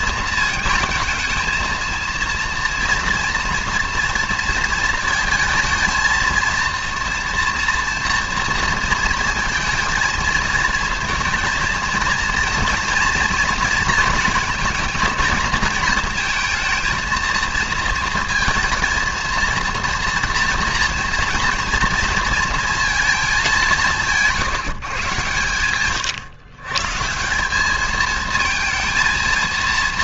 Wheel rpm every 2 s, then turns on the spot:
220, 230, 230, 230, 230, 230, 230, 230, 220, 230, 230, 220, 170, 130, 220.
none